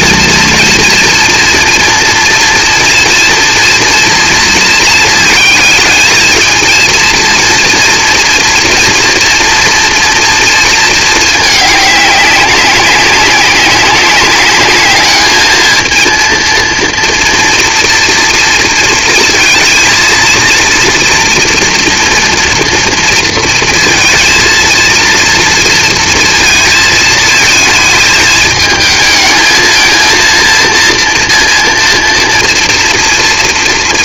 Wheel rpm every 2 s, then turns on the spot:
230, 230, 230, 220, 230, 230, 190, 200, 230, 230, 230, 230, 230, 230, 220, 230, 230.
none